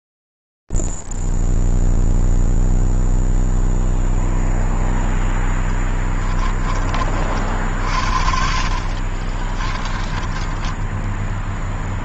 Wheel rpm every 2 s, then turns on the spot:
0, 0, 0, 30, 50, 10.
10-12